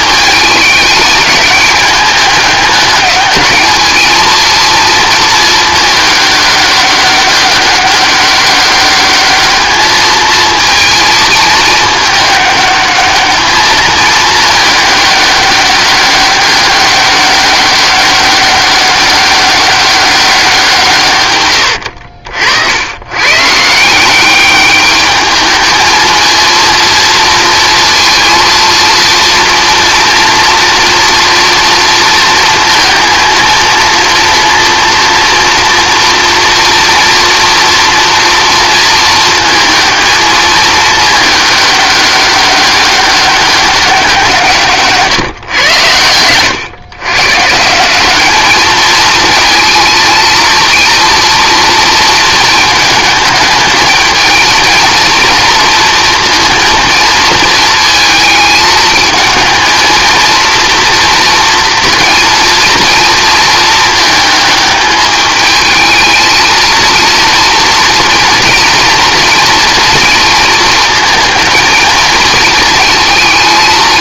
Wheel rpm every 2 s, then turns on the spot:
220, 210, 230, 200, 200, 220, 210, 210, 200, 190, 170, 80, 200, 230, 230, 230, 230, 230, 230, 230, 220, 190, 150, 110, 210, 230, 220, 230, 230, 220, 230, 230, 220, 230, 230, 220, 220.
none